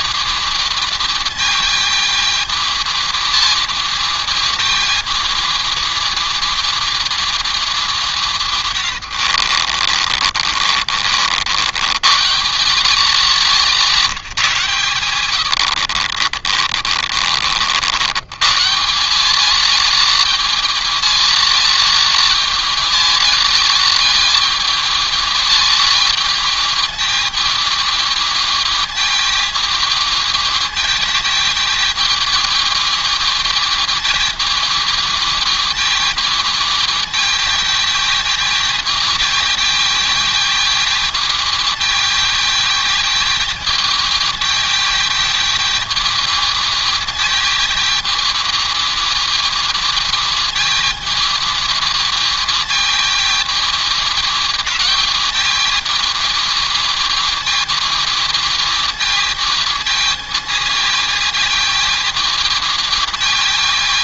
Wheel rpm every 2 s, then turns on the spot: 220, 220, 220, 220, 140, 40, 160, 160, 50, 160, 220, 220, 220, 220, 220, 220, 220, 220, 220, 220, 220, 220, 220, 220, 220, 220, 220, 220, 220, 220, 220, 220.
8-12 16-18